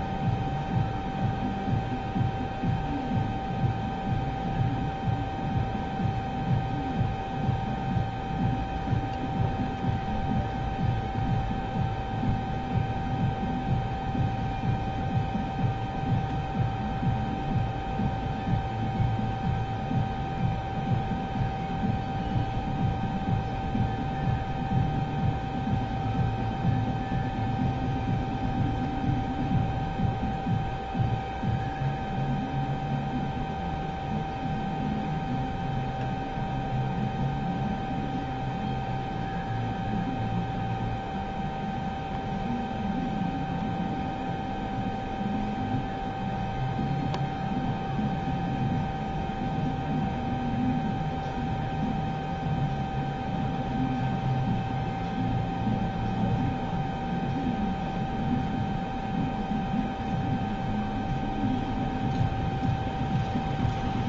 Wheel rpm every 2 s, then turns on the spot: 0, 0, 0, 0, 0, 0, 0, 0, 0, 0, 0, 0, 0, 0, 0, 0, 0, 0, 0, 0, 0, 0, 0, 0, 0, 0, 0, 0, 0, 0, 0, 0.
none